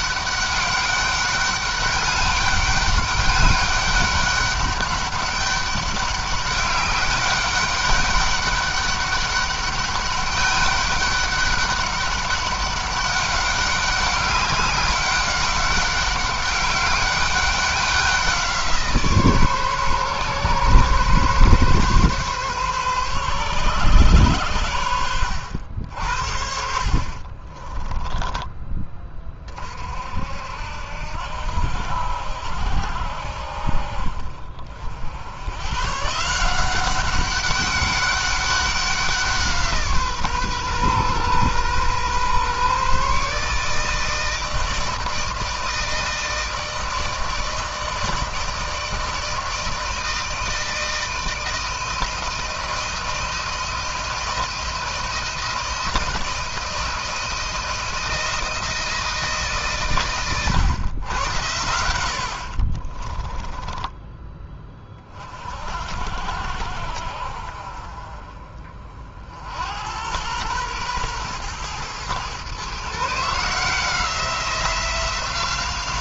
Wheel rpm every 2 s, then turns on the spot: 200, 200, 200, 200, 200, 200, 200, 200, 200, 160, 130, 130, 100, 50, 20, 70, 70, 70, 190, 190, 130, 140, 160, 160, 160, 160, 160, 160, 160, 160, 120, 40, 20, 60, 50, 110, 140, 180.
26-28 62-64